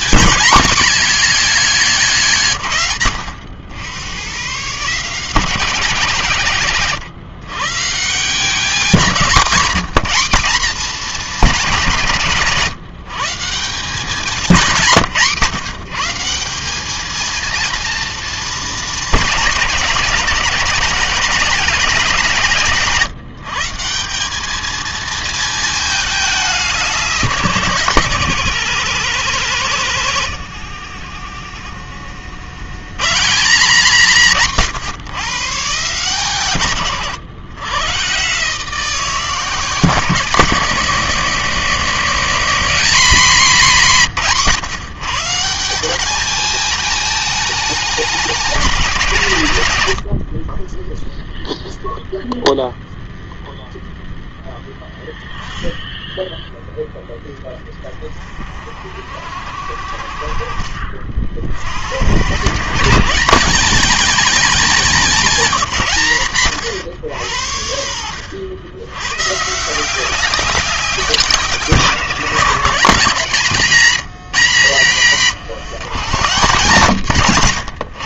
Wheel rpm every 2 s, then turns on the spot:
210, 120, 140, 140, 190, 220, 160, 170, 210, 220, 200, 160, 220, 180, 170, 70, 110, 150, 110, 160, 170, 200, 150, 220, 180, 10, 0, 10, 10, 50, 40, 160, 210, 120, 100, 180, 160, 140, 170.
none